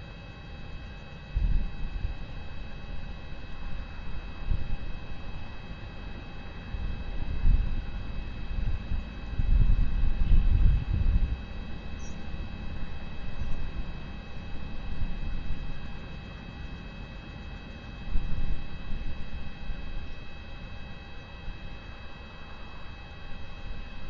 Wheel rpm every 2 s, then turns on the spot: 0, 0, 0, 0, 0, 0, 0, 0, 0, 0, 0, 0.
none